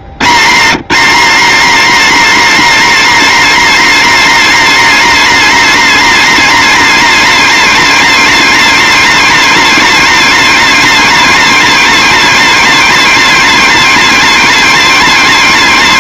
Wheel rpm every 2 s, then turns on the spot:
200, 260, 260, 260, 250, 260, 250, 250.
none